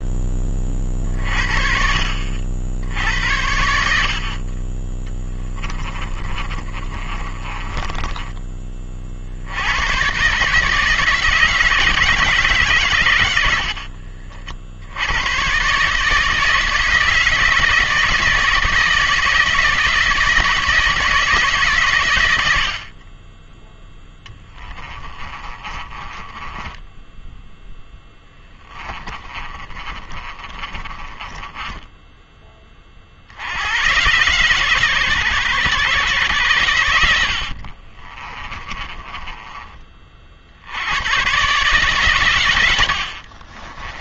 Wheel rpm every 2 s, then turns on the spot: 40, 70, 20, 30, 30, 150, 130, 70, 160, 160, 160, 60, 20, 10, 20, 30, 30, 130, 100, 30, 80, 90.
6-8 24-32 38-40